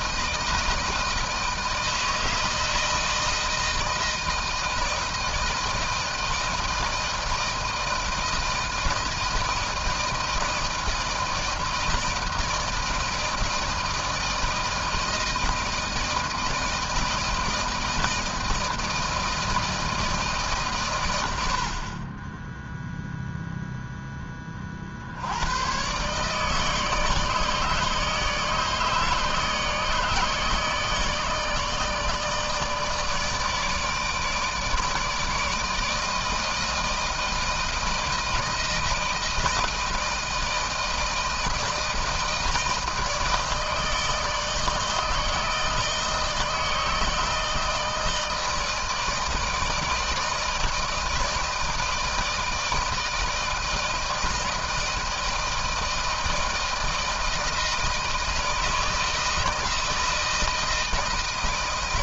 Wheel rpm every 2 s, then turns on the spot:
160, 160, 160, 160, 160, 160, 160, 160, 160, 160, 120, 0, 50, 150, 150, 160, 160, 160, 160, 170, 160, 160, 160, 160, 160, 160, 160, 160, 160, 160, 160.
none